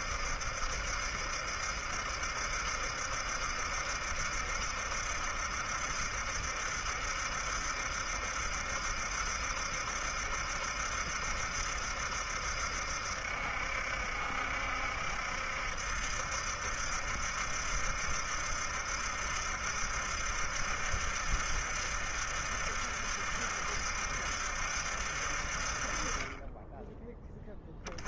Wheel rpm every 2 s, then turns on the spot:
70, 70, 70, 70, 70, 70, 70, 70, 70, 70, 70, 70, 60, 10.
none